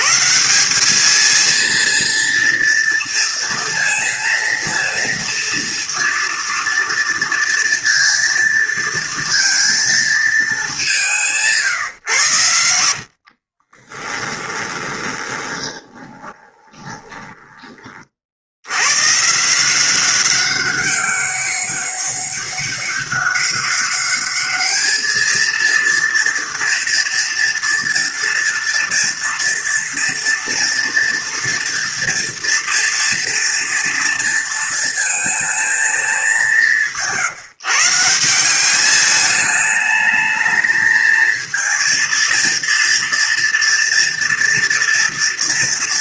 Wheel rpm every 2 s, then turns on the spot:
170, 230, 230, 230, 230, 210, 90, 20, 20, 80, 190, 200, 210, 230, 240, 240, 230, 230, 190, 190, 220, 230, 230.
14-18